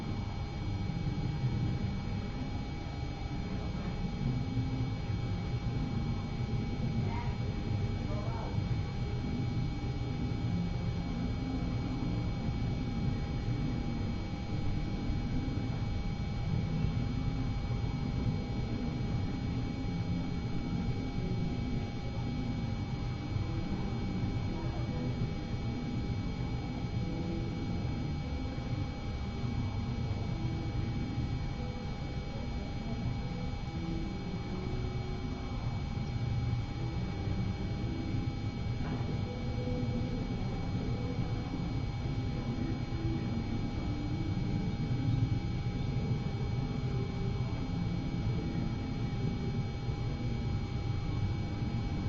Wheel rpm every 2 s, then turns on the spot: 0, 0, 0, 0, 0, 0, 0, 0, 0, 0, 0, 0, 0, 0, 0, 0, 0, 0, 0, 0, 0, 0, 0, 0, 0, 0.
none